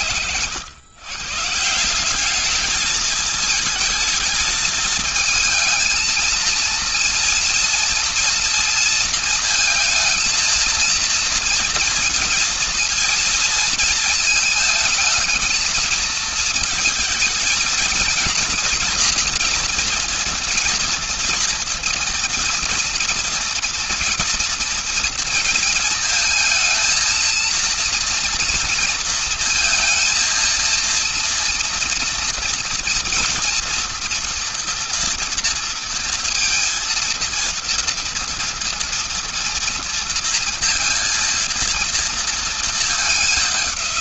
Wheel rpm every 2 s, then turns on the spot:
160, 220, 220, 230, 230, 230, 230, 220, 230, 230, 230, 230, 230, 230, 230, 230, 240, 230, 230, 230, 230, 190.
none